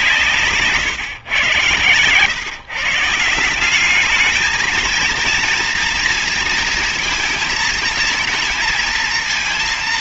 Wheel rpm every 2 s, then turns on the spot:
140, 140, 220, 230, 230.
none